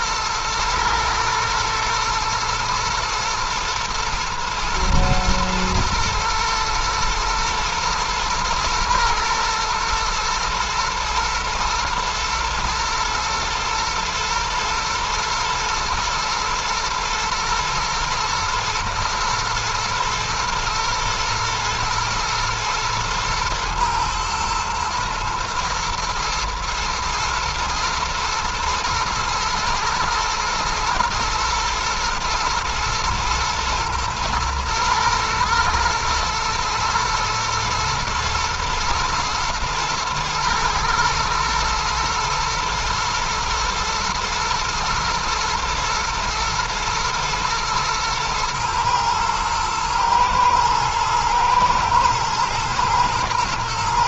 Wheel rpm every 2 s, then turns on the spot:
110, 120, 120, 110, 120, 110, 110, 120, 110, 120, 110, 110, 120, 110, 120, 120, 110, 120, 120, 110, 110, 110, 110, 110, 110, 120, 110.
none